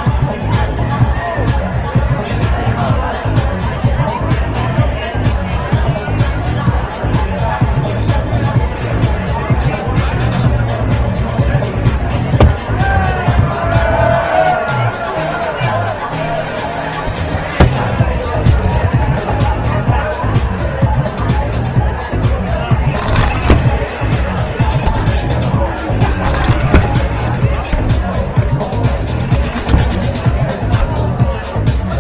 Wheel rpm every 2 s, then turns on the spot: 0, 0, 0, 0, 0, 0, 0, 0, 0, 0, 0, 0, 0, 0, 0, 0.
none